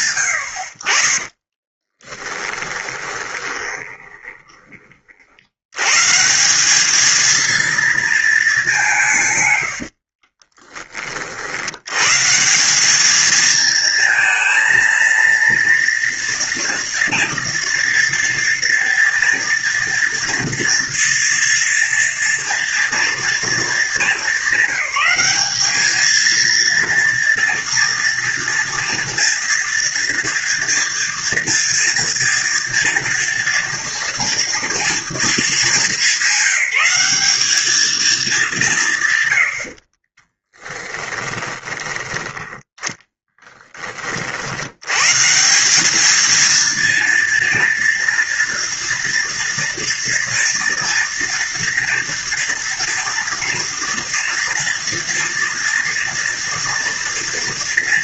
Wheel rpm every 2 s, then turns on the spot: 80, 20, 40, 210, 190, 30, 200, 230, 230, 230, 230, 230, 200, 230, 230, 230, 230, 230, 200, 180, 20, 10, 100, 230, 230, 230, 230, 230, 230.
2-4 40-44